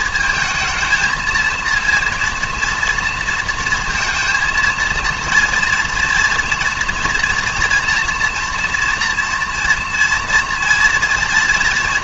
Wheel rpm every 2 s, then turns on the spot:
230, 230, 230, 230, 240, 230.
none